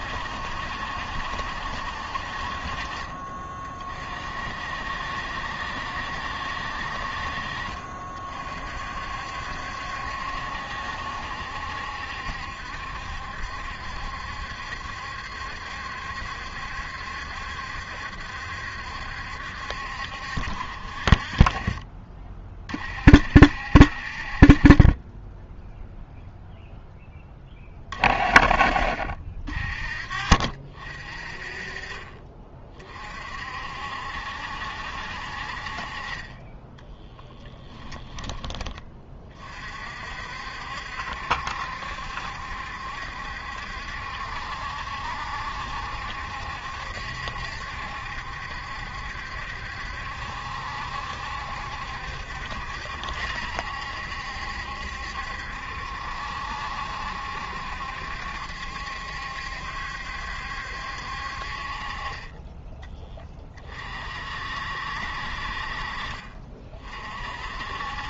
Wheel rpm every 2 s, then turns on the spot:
70, 40, 60, 60, 50, 70, 70, 70, 70, 70, 50, 50, 30, 0, 40, 50, 30, 60, 10, 30, 60, 70, 70, 70, 70, 70, 70, 70, 70, 70, 70, 20, 60, 40.
none